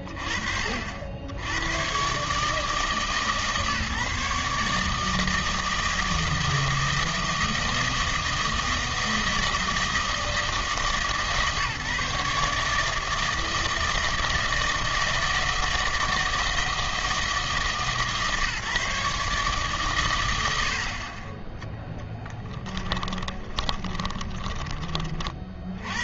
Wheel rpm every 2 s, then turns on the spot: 50, 150, 150, 160, 160, 160, 150, 160, 160, 140, 70, 20, 30.
22-26